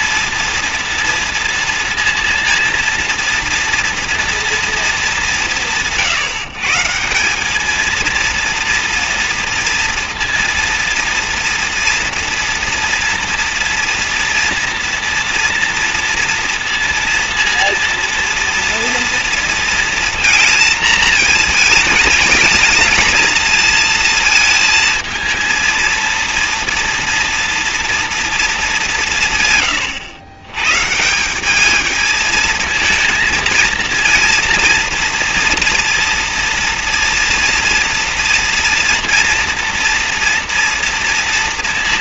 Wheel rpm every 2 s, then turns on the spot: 230, 230, 230, 160, 230, 240, 230, 230, 230, 230, 230, 220, 220, 230, 220, 120, 220, 230, 230, 230, 230.
none